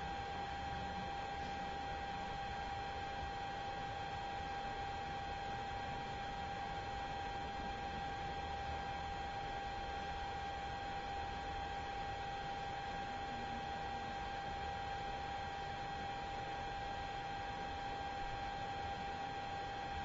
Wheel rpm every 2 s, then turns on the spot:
0, 0, 0, 0, 0, 0, 0, 0, 0, 0.
none